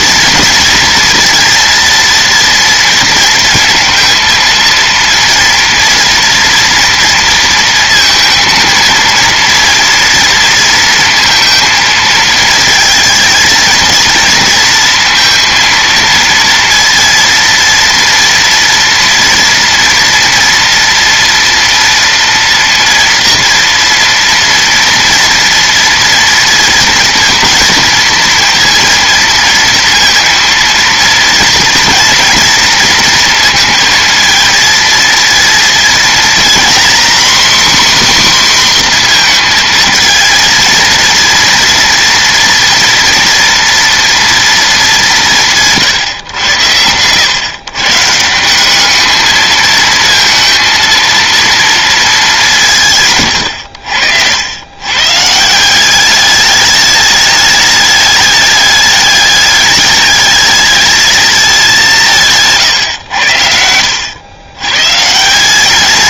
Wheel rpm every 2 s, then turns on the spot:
230, 230, 240, 230, 230, 230, 230, 230, 230, 230, 230, 230, 230, 230, 230, 230, 230, 230, 260, 230, 230, 230, 160, 110, 220, 230, 100, 160, 210, 210, 200, 80, 190.
52-54